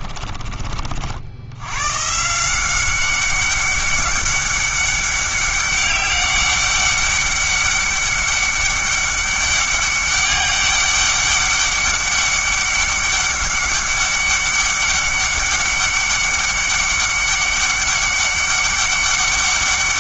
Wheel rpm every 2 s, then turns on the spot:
40, 180, 200, 200, 200, 200, 200, 200, 200, 200.
none